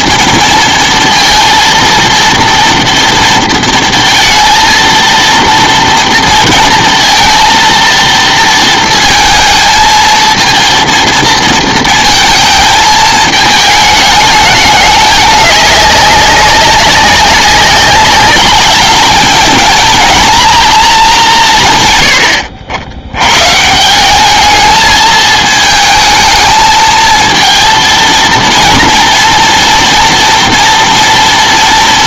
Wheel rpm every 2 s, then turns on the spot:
230, 230, 230, 230, 230, 230, 220, 210, 190, 210, 230, 80, 220, 220, 230, 230.
none